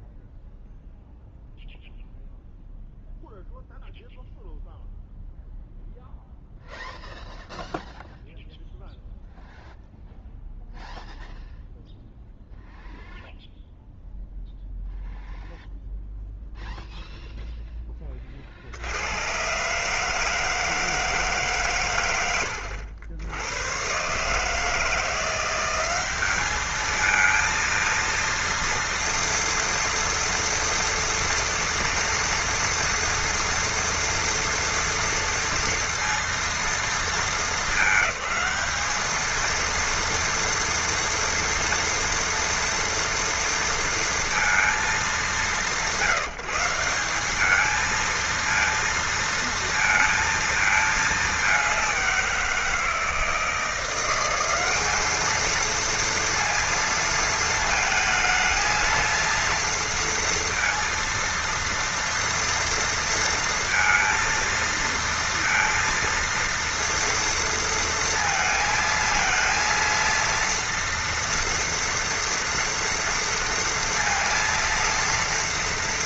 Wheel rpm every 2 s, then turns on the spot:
0, 0, 0, 0, 0, 0, 0, 0, 0, 50, 160, 90, 160, 210, 230, 230, 230, 230, 230, 210, 230, 230, 220, 180, 230, 220, 170, 200, 230, 220, 230, 230, 230, 230, 220, 230, 230, 230.
none